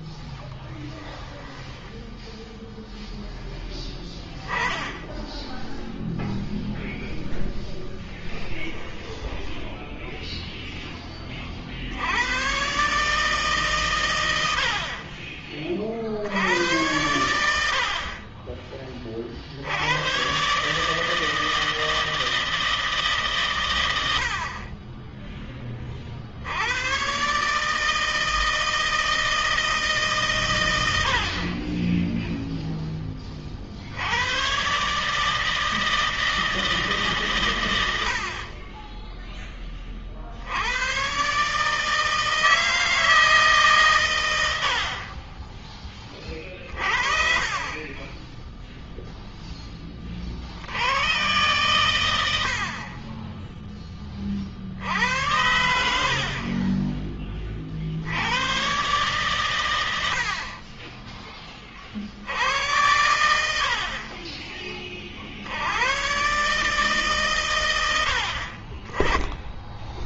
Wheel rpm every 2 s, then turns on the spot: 10, 0, 10, 10, 20, 10, 140, 50, 90, 20, 140, 160, 30, 110, 160, 70, 10, 130, 160, 30, 70, 160, 80, 40, 10, 40, 70, 60, 30, 100, 50, 70, 40, 90, 80.
0-2 4-6 8-10 44-46